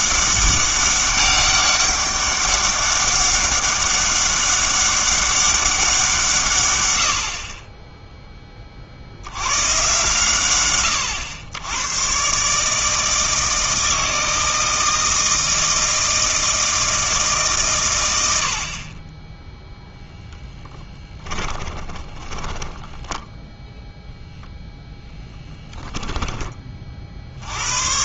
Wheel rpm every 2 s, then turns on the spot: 200, 200, 200, 130, 30, 110, 150, 160, 160, 70, 10, 10, 0, 30.
20-24